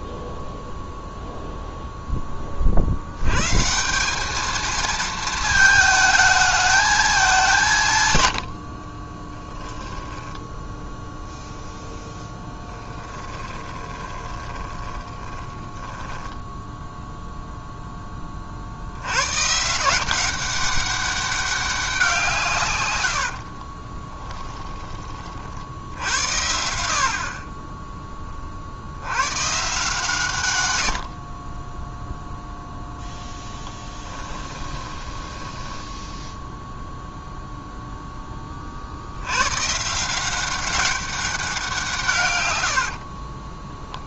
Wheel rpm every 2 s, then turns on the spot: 0, 60, 220, 220, 50, 0, 10, 20, 10, 50, 190, 140, 20, 70, 50, 110, 0, 10, 0, 40, 190, 100.
12-16 34-36 42-44